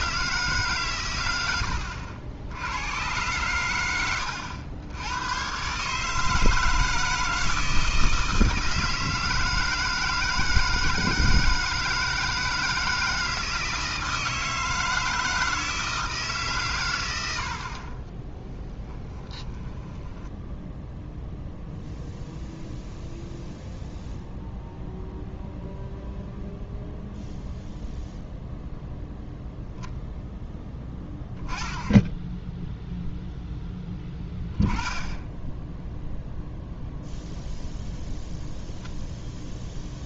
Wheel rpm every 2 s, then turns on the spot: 140, 90, 90, 160, 160, 160, 160, 160, 130, 20, 10, 0, 0, 0, 0, 10, 0, 10, 0, 0.
18-22